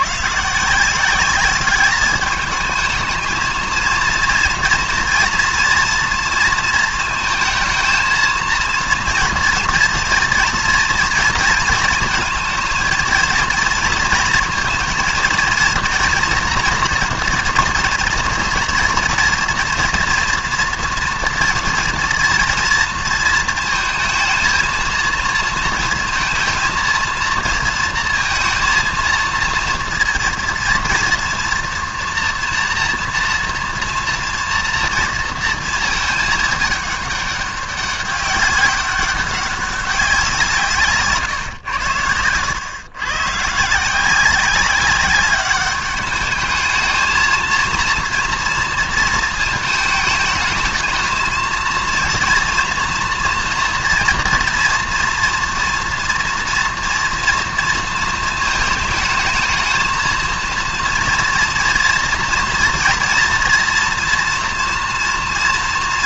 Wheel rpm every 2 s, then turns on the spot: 150, 210, 230, 230, 230, 230, 220, 230, 230, 230, 230, 230, 230, 220, 230, 240, 240, 230, 220, 200, 180, 100, 190, 210, 230, 220, 230, 230, 230, 220, 230, 240, 240.
none